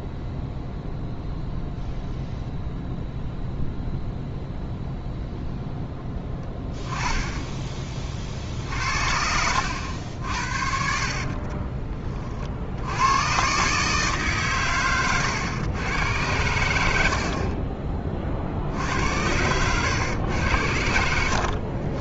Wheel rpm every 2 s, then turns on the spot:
0, 0, 0, 10, 50, 60, 60, 130, 80, 60, 90.
10-12